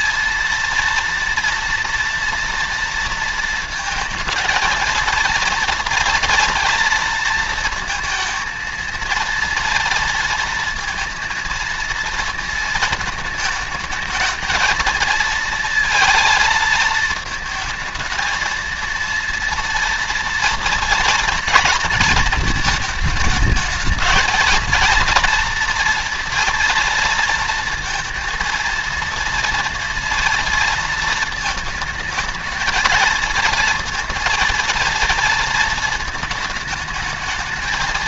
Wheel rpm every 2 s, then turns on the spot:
230, 230, 220, 230, 230, 230, 230, 230, 230, 230, 230, 220, 230, 240, 230, 230, 220, 230, 210.
none